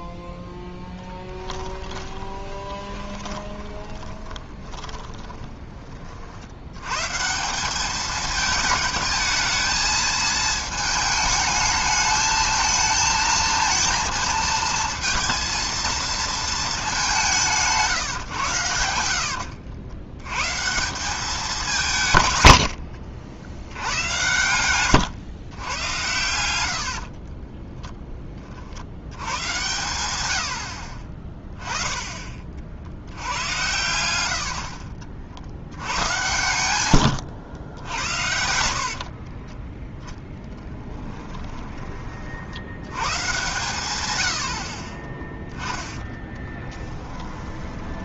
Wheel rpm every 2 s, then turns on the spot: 10, 20, 20, 120, 220, 220, 220, 220, 210, 90, 160, 80, 120, 80, 60, 70, 20, 70, 110, 70, 10, 90, 40, 20.
0-6 18-20 22-24 36-42 46-48